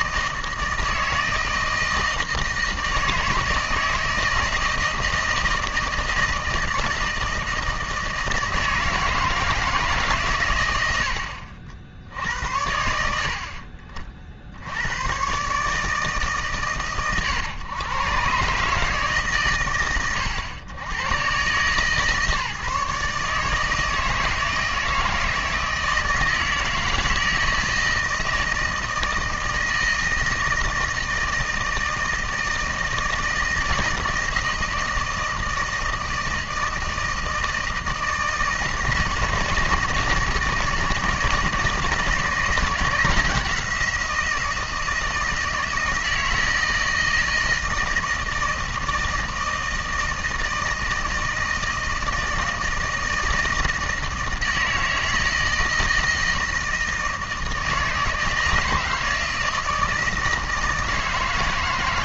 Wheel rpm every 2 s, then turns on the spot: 160, 160, 160, 160, 160, 120, 80, 70, 140, 140, 100, 150, 160, 160, 160, 160, 160, 160, 160, 160, 170, 160, 170, 160, 160, 160, 160, 160, 160, 160, 160.
none